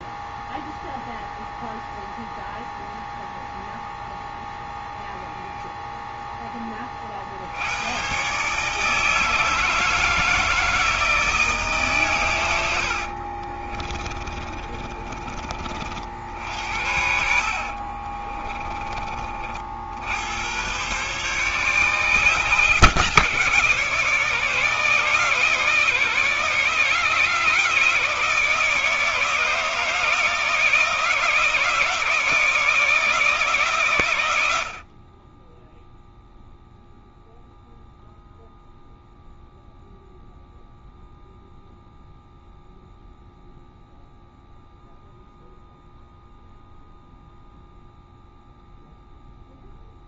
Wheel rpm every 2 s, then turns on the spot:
0, 0, 0, 20, 140, 160, 90, 30, 70, 20, 110, 160, 150, 150, 160, 160, 160, 80, 0, 0, 0, 0, 0, 0, 0.
12-18